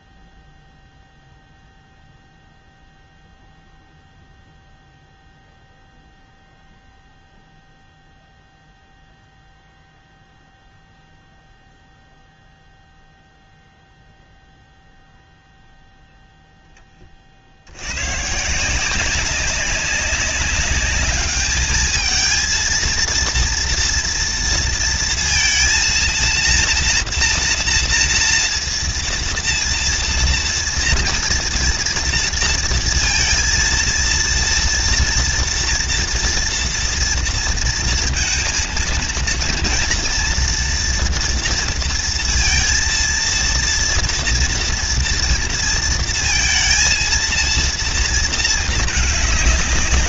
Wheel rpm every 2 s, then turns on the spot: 0, 0, 0, 0, 0, 0, 0, 0, 10, 160, 200, 230, 230, 230, 230, 230, 230, 230, 240, 230, 240, 230, 230, 230, 220.
none